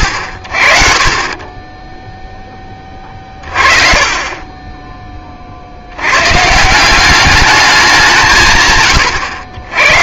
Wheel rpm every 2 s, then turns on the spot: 40, 20, 10, 150, 100.
4-6